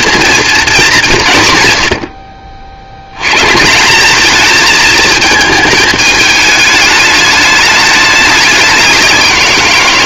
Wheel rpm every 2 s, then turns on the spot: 220, 60, 220, 210, 190.
none